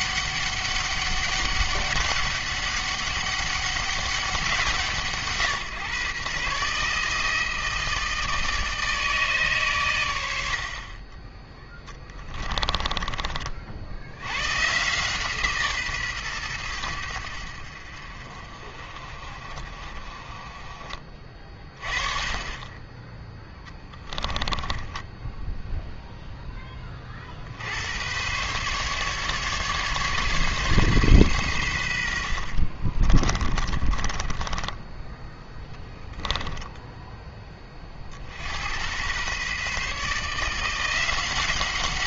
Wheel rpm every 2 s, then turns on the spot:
200, 200, 170, 140, 160, 50, 20, 130, 100, 40, 30, 20, 20, 20, 140, 140, 40, 20, 10, 100, 170.
12-14 24-26 32-38